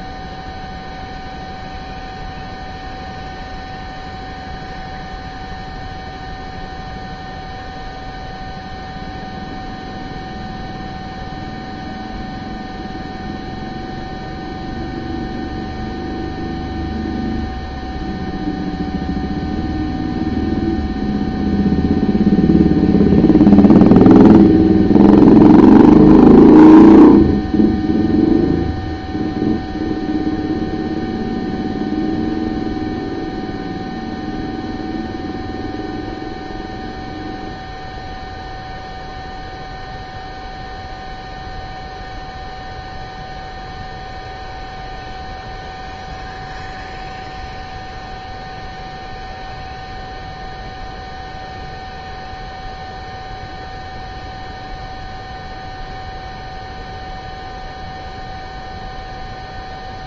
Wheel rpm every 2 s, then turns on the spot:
0, 0, 0, 0, 0, 0, 0, 0, 0, 0, 0, 0, 0, 0, 0, 0, 0, 0, 0, 0, 0, 0, 0, 0, 0, 0, 0, 0, 0, 0.
none